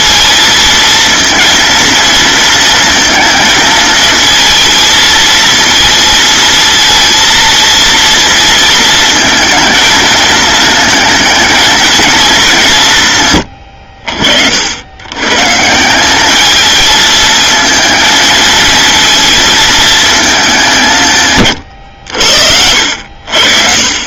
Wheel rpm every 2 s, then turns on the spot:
230, 230, 230, 230, 230, 220, 170, 80, 220, 230, 160, 70.
none